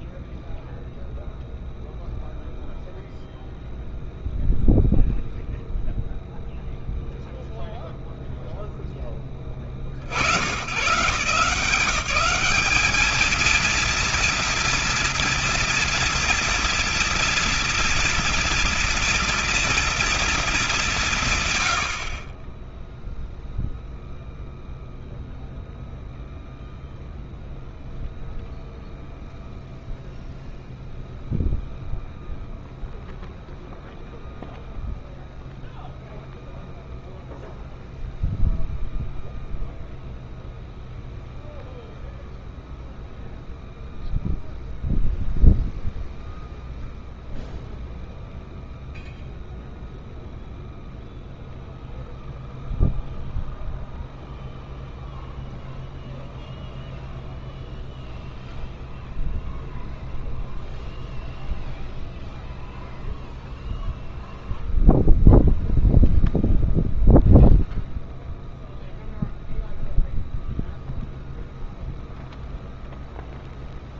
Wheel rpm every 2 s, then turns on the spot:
0, 0, 0, 0, 0, 90, 190, 230, 230, 230, 200, 20, 0, 0, 0, 0, 0, 0, 0, 0, 0, 0, 0, 0, 0, 0, 0, 0, 0, 0, 0, 0, 0, 0, 0, 0, 0.
none